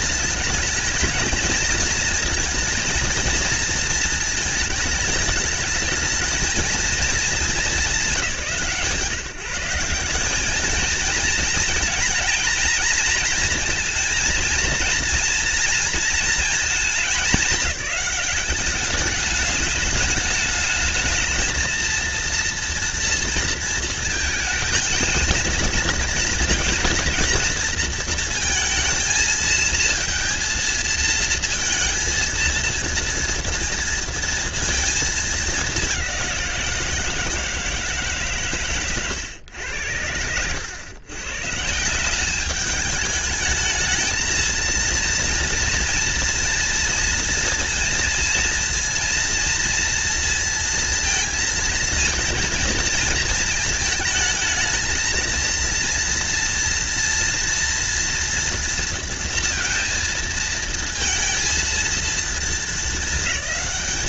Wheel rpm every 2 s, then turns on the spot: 220, 230, 220, 210, 150, 220, 220, 230, 220, 210, 220, 230, 230, 230, 220, 230, 230, 220, 170, 110, 120, 210, 230, 230, 230, 230, 220, 220, 230, 230, 230, 220.
none